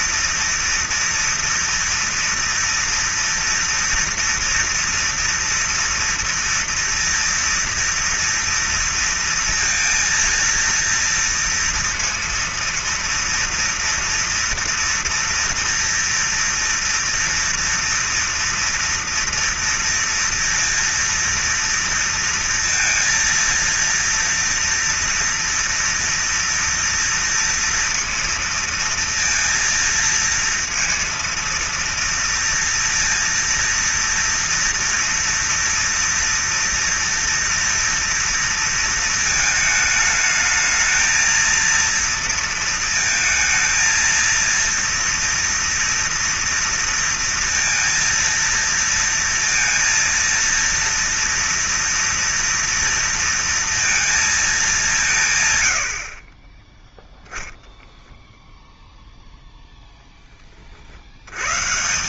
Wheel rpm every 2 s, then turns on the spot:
230, 240, 230, 230, 230, 230, 230, 230, 230, 240, 230, 230, 230, 230, 230, 230, 230, 230, 230, 230, 220, 230, 230, 230, 230, 230, 230, 180, 10, 0, 50.
none